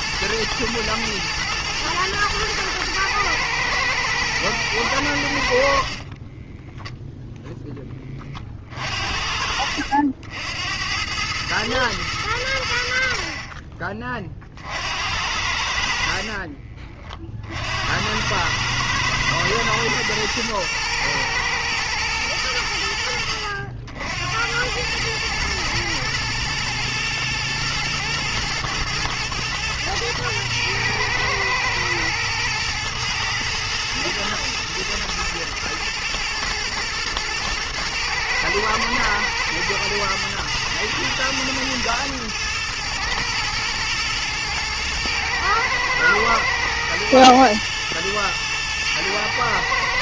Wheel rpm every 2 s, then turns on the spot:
110, 110, 60, 0, 60, 110, 50, 70, 40, 110, 110, 80, 110, 110, 120, 120, 110, 120, 110, 110, 110, 110, 110, 110, 110.
4-6 8-10